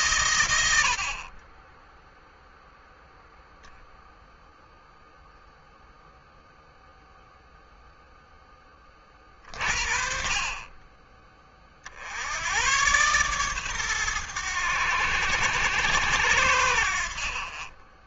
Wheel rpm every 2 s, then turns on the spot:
80, 10, 0, 0, 30, 30, 120, 80, 50.
none